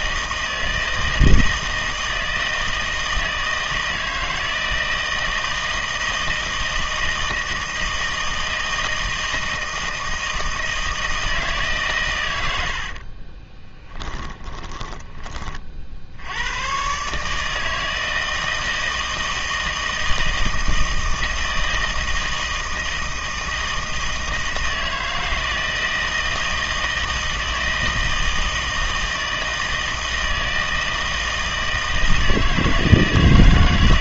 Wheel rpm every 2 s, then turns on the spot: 160, 160, 160, 160, 160, 160, 80, 20, 110, 160, 160, 160, 160, 160, 160, 160, 160.
12-16